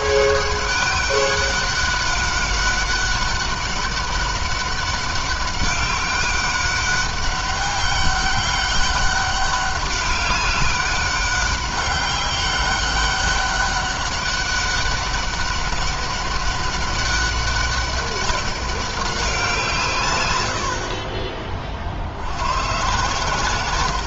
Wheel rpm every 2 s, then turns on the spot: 200, 200, 200, 200, 200, 200, 190, 200, 200, 200, 70, 110.
none